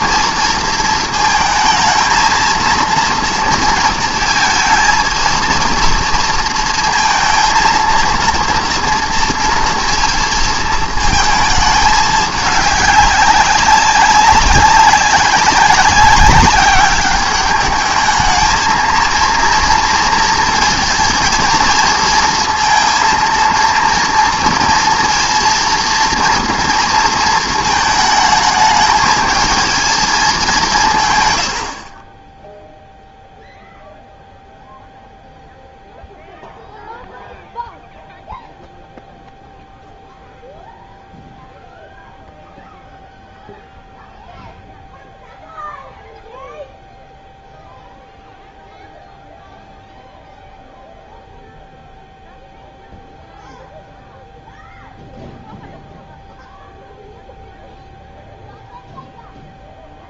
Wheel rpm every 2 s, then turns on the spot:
230, 230, 230, 230, 230, 230, 200, 200, 200, 220, 230, 230, 230, 240, 220, 180, 0, 0, 0, 0, 0, 0, 0, 0, 0, 0, 0, 0, 0, 0.
none